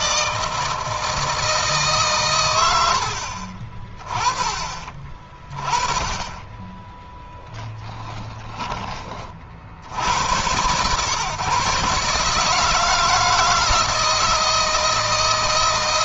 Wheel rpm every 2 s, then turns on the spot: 160, 90, 30, 10, 30, 110, 160, 160.
none